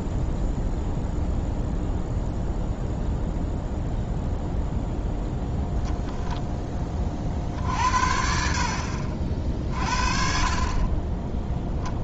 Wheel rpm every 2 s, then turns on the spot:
0, 0, 0, 20, 50, 30.
none